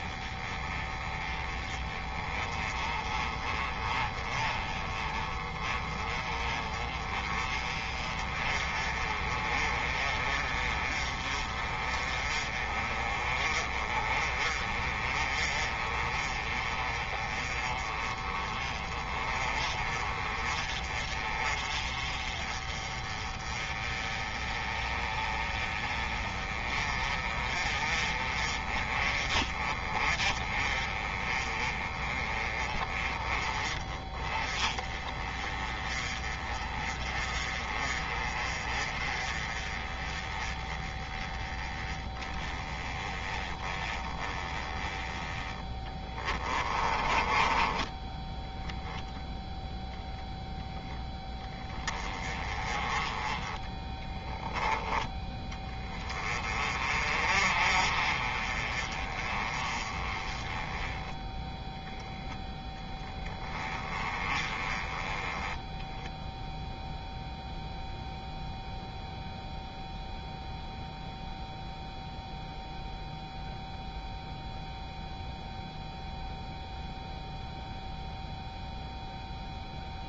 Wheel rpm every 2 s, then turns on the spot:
20, 20, 20, 30, 30, 30, 30, 30, 30, 30, 30, 30, 30, 30, 30, 30, 20, 20, 30, 30, 20, 10, 10, 20, 0, 10, 20, 10, 30, 30, 10, 10, 20, 0, 0, 0, 0, 0, 0, 0.
46-48